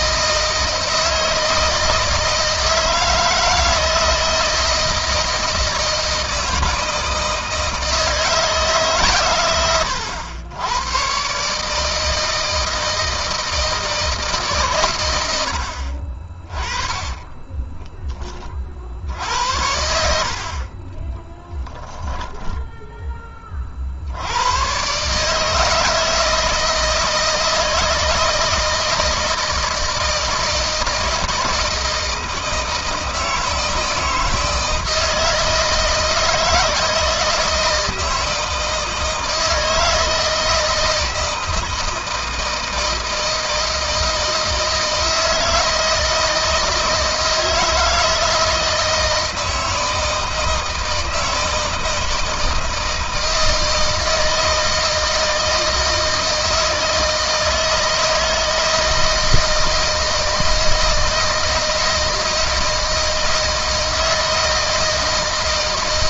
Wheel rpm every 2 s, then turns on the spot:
160, 160, 160, 160, 150, 100, 160, 140, 30, 40, 50, 10, 100, 160, 160, 160, 160, 160, 160, 160, 160, 160, 160, 160, 160, 160, 160, 160, 160, 160, 160, 160, 160.
22-24